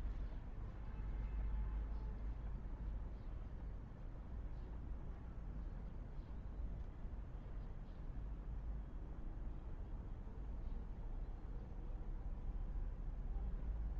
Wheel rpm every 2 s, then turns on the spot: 0, 0, 0, 0, 0, 0, 0.
none